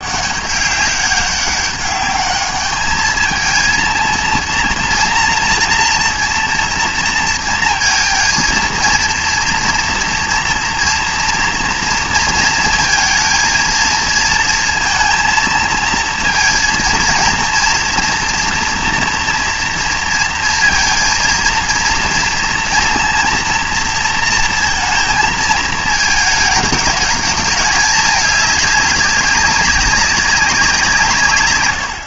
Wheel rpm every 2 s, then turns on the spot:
200, 210, 230, 230, 230, 230, 230, 230, 230, 230, 230, 230, 230, 220, 200, 180.
none